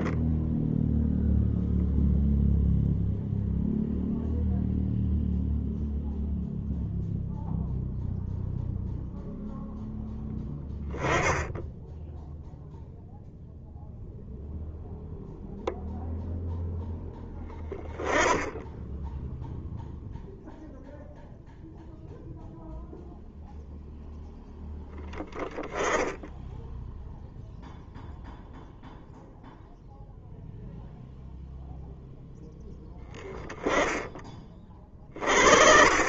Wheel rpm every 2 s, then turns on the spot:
0, 0, 0, 0, 0, 20, 0, 0, 0, 10, 0, 0, 10, 0, 0, 0, 10, 40.
none